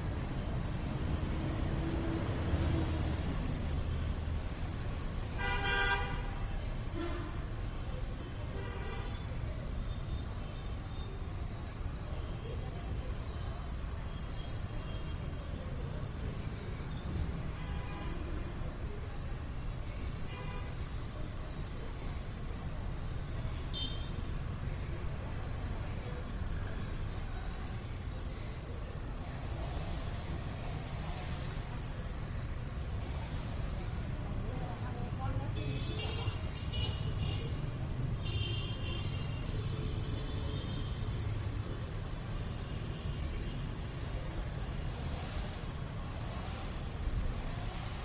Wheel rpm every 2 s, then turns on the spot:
0, 0, 0, 0, 0, 0, 0, 0, 0, 0, 0, 0, 0, 0, 0, 0, 0, 0, 0, 0, 0, 0, 0, 0.
none